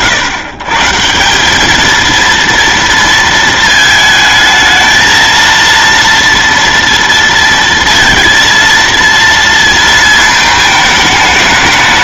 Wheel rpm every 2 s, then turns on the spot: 140, 230, 220, 230, 230, 220.
none